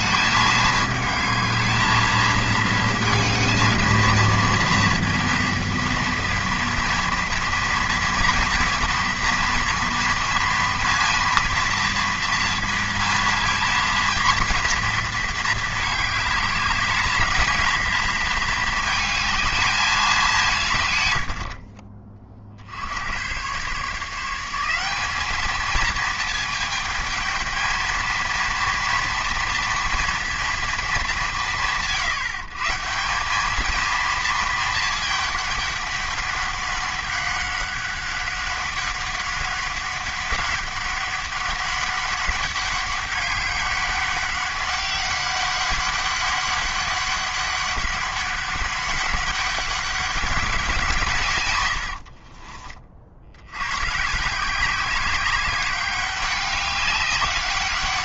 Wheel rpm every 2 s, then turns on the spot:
210, 230, 230, 230, 230, 230, 230, 230, 210, 220, 130, 80, 190, 220, 230, 220, 160, 220, 200, 200, 200, 200, 200, 200, 200, 180, 40, 190, 200.
none